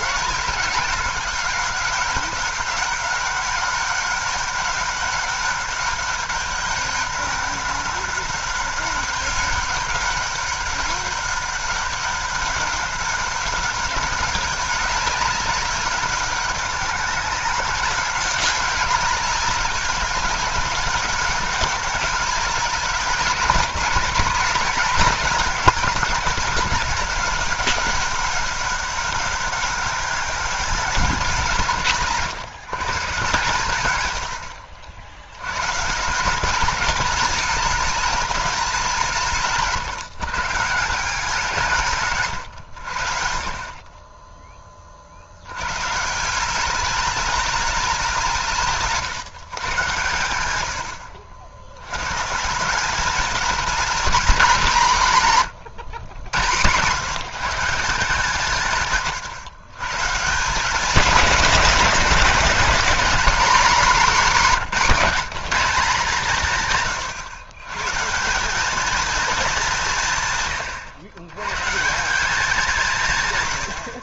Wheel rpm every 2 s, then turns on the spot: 200, 190, 200, 200, 200, 200, 200, 200, 190, 200, 200, 190, 220, 200, 200, 190, 140, 60, 200, 200, 160, 110, 20, 190, 160, 90, 180, 180, 120, 140, 200, 210, 190, 150, 210, 120, 180.
none